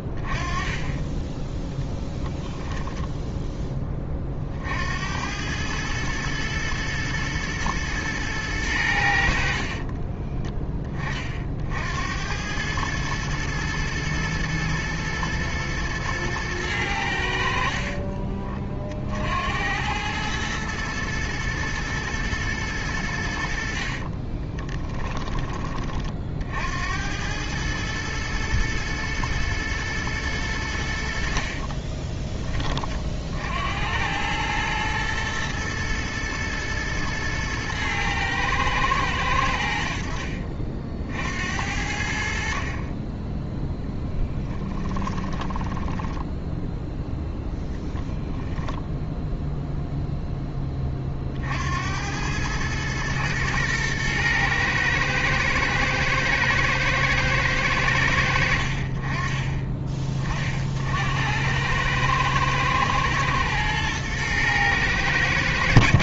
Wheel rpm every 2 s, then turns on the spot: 20, 10, 60, 110, 90, 20, 100, 110, 110, 60, 110, 110, 20, 70, 110, 90, 30, 110, 120, 110, 60, 40, 10, 0, 0, 20, 110, 110, 110, 60, 50, 110, 110.
24-26 44-46